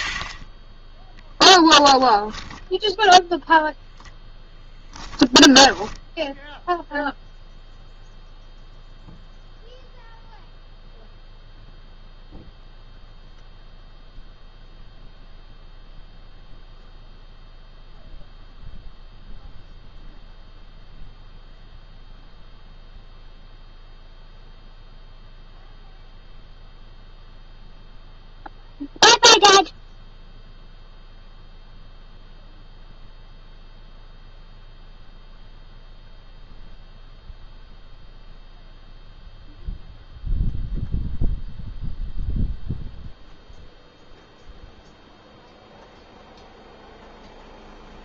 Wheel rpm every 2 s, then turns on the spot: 50, 20, 10, 0, 0, 0, 0, 0, 0, 0, 0, 0, 0, 0, 0, 0, 0, 0, 0, 0, 0, 0, 0, 0.
2-6